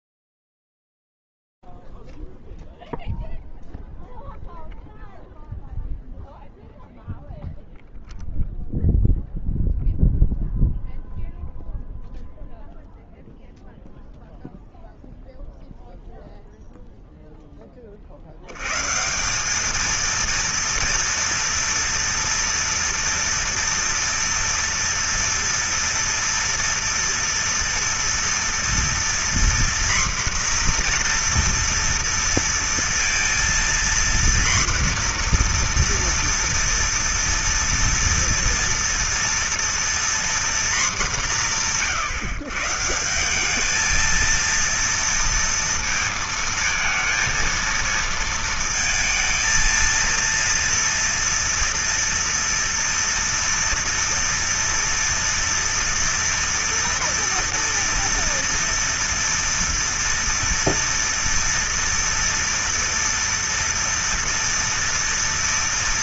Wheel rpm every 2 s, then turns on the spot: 0, 0, 0, 0, 0, 0, 0, 0, 0, 130, 230, 230, 230, 230, 240, 240, 230, 240, 240, 230, 210, 170, 230, 230, 220, 230, 230, 230, 230, 230, 230, 230, 230.
none